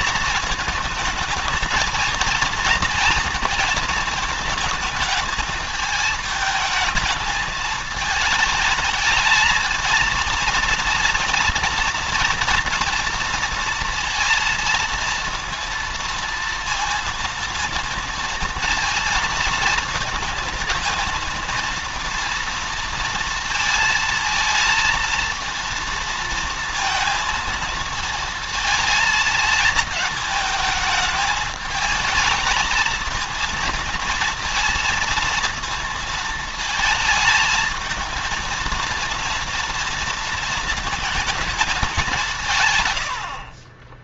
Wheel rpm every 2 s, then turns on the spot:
220, 230, 220, 220, 220, 230, 230, 230, 230, 230, 230, 230, 230, 230, 220, 220, 220, 230, 220, 230, 220, 120.
42-44